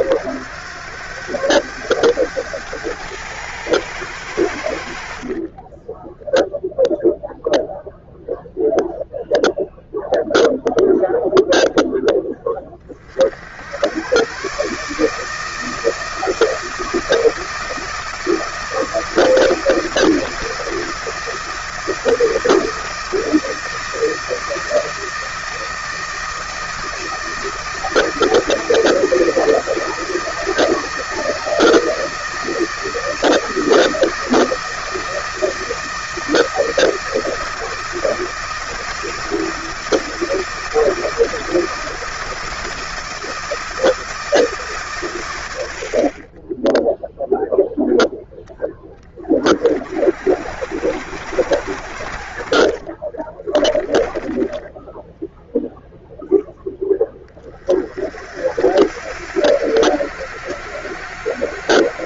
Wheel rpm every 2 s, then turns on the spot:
90, 100, 80, 0, 0, 0, 20, 140, 160, 160, 160, 160, 160, 160, 160, 160, 160, 160, 160, 160, 160, 160, 150, 10, 10, 70, 40, 10, 10, 70, 90.
52-54